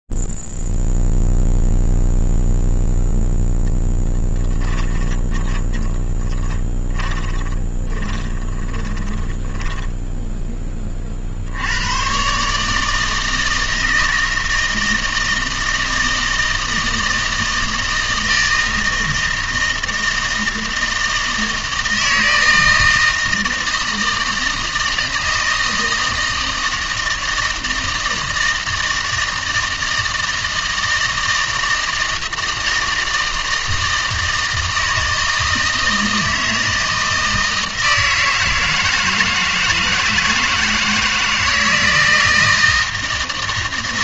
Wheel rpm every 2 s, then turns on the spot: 0, 0, 10, 20, 20, 10, 120, 160, 160, 160, 160, 160, 160, 160, 160, 160, 160, 160, 160, 160, 160, 160.
4-12